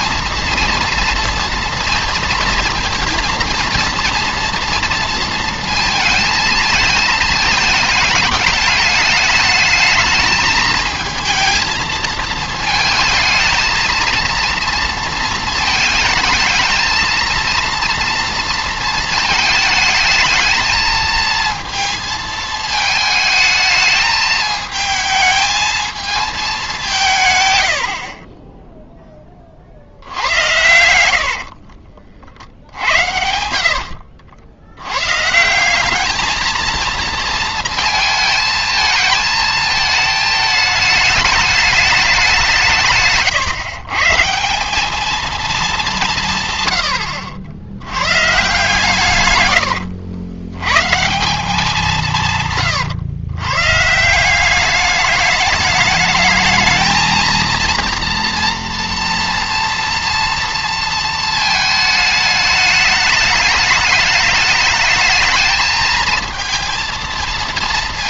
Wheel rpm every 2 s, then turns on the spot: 230, 230, 230, 220, 210, 220, 220, 230, 220, 230, 220, 220, 220, 190, 10, 100, 70, 100, 230, 220, 220, 160, 200, 100, 140, 110, 140, 200, 220, 230, 230, 210, 210, 230.
32-34 52-54